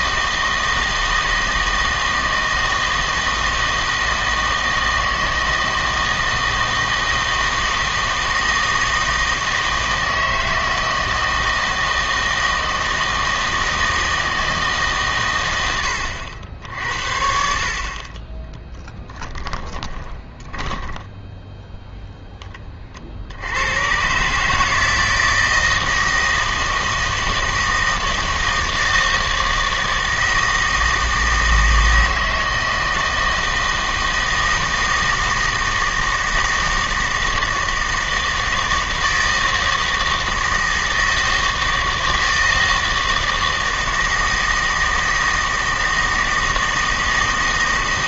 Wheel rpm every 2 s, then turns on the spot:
160, 160, 160, 160, 160, 160, 160, 140, 70, 10, 10, 40, 160, 160, 160, 160, 160, 160, 160, 160, 160, 160, 160, 160.
18-22